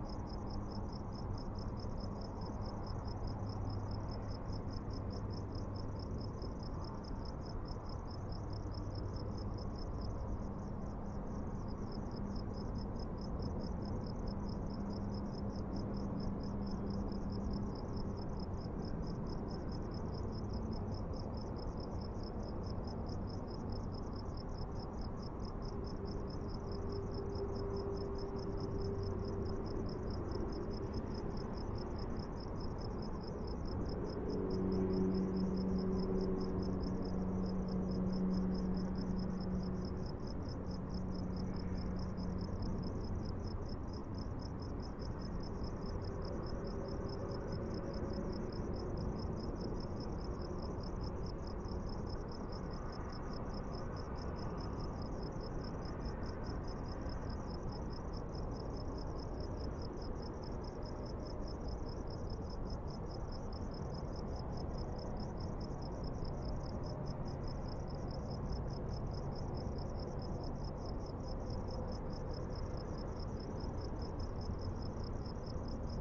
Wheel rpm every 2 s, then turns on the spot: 0, 0, 0, 0, 0, 0, 0, 0, 0, 0, 0, 0, 0, 0, 0, 0, 0, 0, 0, 0, 0, 0, 0, 0, 0, 0, 0, 0, 0, 0, 0, 0, 0, 0, 0, 0, 0, 0.
none